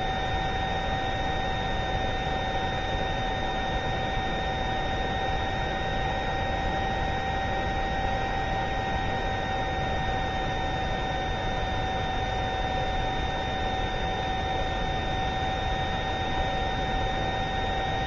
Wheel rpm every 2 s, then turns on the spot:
0, 0, 0, 0, 0, 0, 0, 0, 0.
none